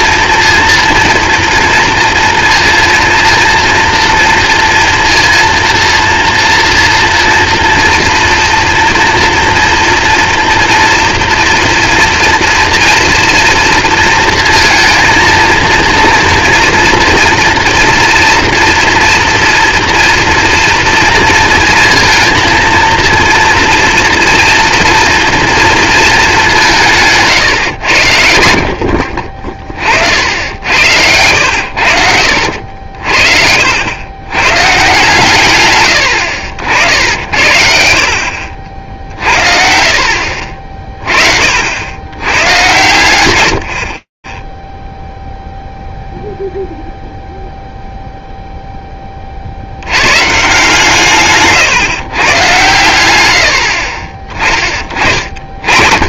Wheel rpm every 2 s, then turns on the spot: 230, 230, 230, 230, 230, 230, 230, 230, 230, 230, 230, 230, 230, 160, 50, 80, 60, 140, 60, 60, 40, 120, 0, 0, 20, 160, 110, 40.
32-34